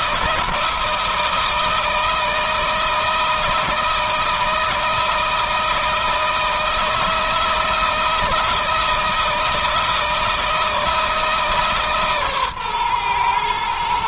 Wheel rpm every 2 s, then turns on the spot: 160, 160, 160, 160, 160, 160, 120.
none